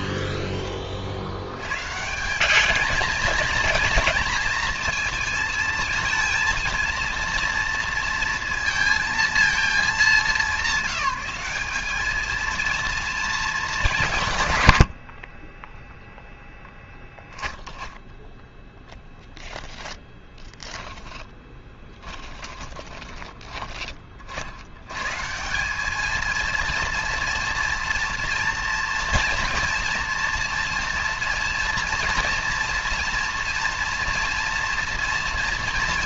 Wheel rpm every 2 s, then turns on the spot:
10, 190, 230, 230, 230, 200, 220, 130, 0, 10, 20, 20, 60, 220, 230, 240, 230, 240.
20-24